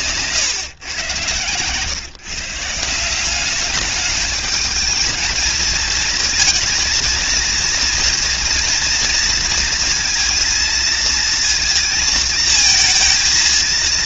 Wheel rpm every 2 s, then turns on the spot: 120, 180, 220, 230, 230, 230, 220.
none